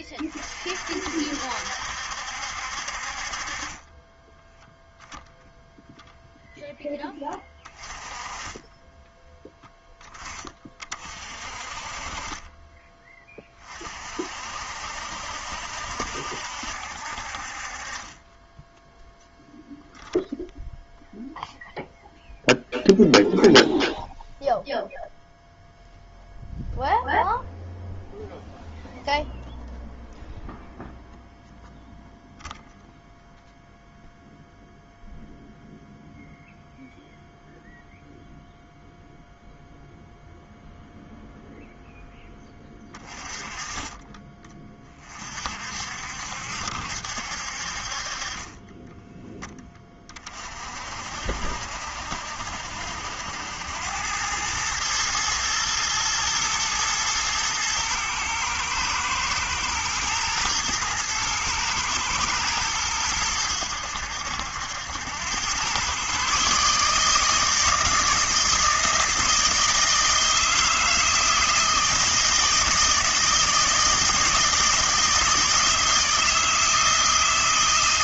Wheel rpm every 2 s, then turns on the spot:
40, 60, 0, 10, 20, 30, 20, 60, 70, 10, 0, 0, 0, 0, 0, 0, 0, 0, 0, 0, 0, 20, 20, 70, 20, 40, 70, 110, 120, 110, 110, 110, 80, 140, 160, 160, 160, 160, 160.
none